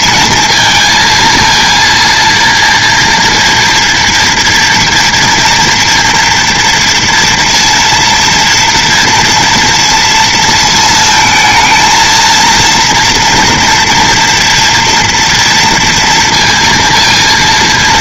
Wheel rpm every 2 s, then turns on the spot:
230, 230, 230, 240, 240, 230, 230, 240, 230.
none